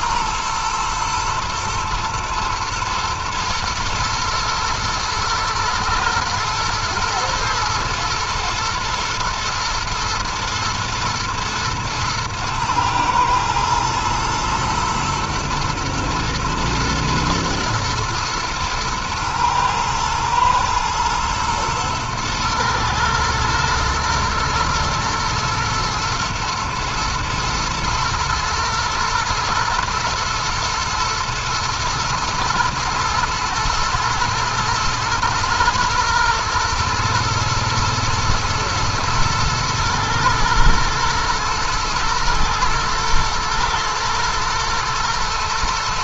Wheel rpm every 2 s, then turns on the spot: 110, 110, 110, 120, 110, 110, 110, 120, 120, 110, 120, 110, 110, 110, 110, 120, 110, 110, 120, 110, 110, 110, 110.
none